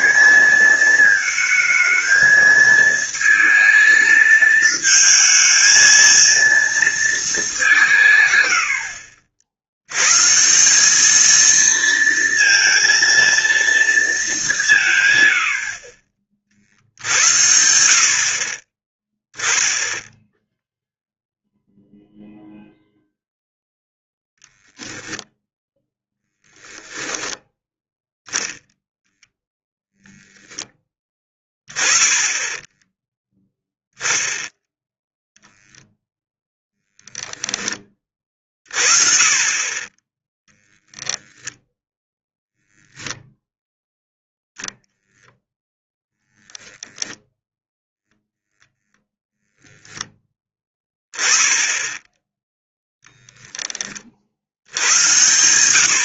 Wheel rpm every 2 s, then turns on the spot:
230, 220, 220, 230, 100, 170, 230, 170, 40, 40, 0, 0, 10, 0, 0, 0, 10, 0, 0, 30, 0, 0, 0, 0, 0, 10, 10, 80.
none